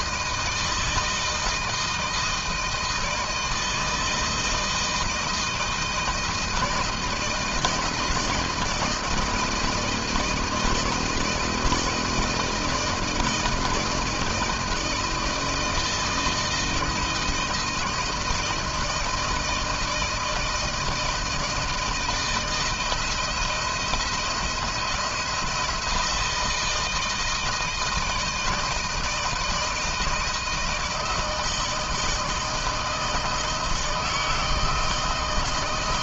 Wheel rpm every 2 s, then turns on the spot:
160, 160, 160, 160, 160, 160, 160, 160, 160, 160, 160, 170, 170, 160, 160, 160, 160, 160.
none